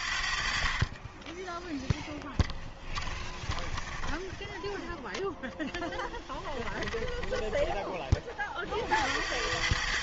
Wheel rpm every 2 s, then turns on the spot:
40, 10, 0, 20, 50.
2-4 6-8